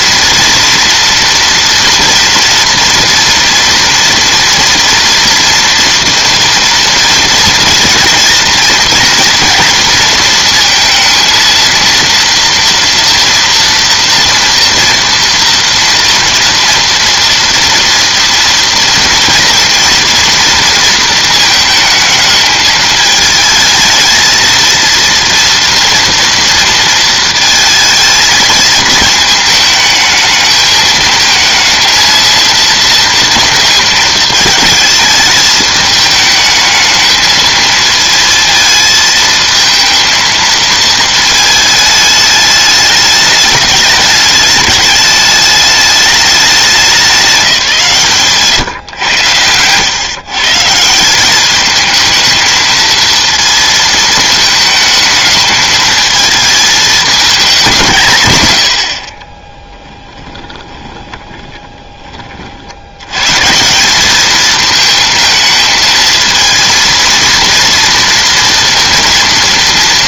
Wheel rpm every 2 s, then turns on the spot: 240, 230, 230, 240, 230, 230, 230, 230, 230, 230, 230, 220, 230, 230, 220, 220, 230, 220, 220, 220, 220, 210, 210, 190, 120, 160, 230, 220, 220, 80, 20, 60, 220, 230, 230.
60-62